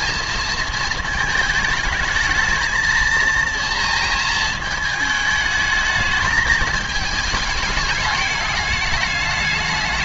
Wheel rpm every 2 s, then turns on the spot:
220, 230, 220, 220, 210.
none